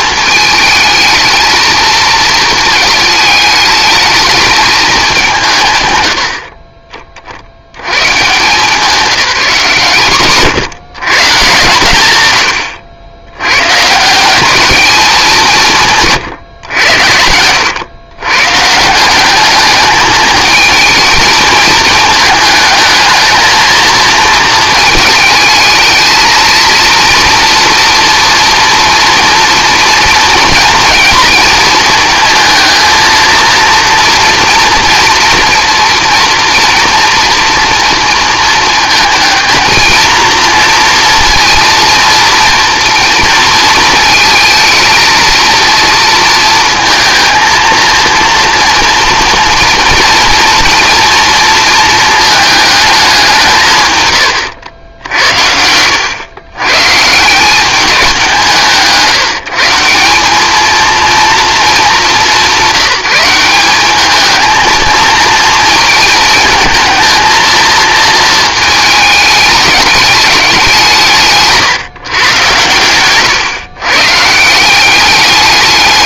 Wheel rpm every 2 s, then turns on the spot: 220, 220, 220, 30, 180, 160, 90, 200, 100, 160, 220, 220, 220, 230, 240, 230, 220, 240, 240, 230, 230, 230, 230, 230, 240, 230, 210, 80, 130, 160, 220, 180, 230, 220, 220, 180, 110, 180.
72-74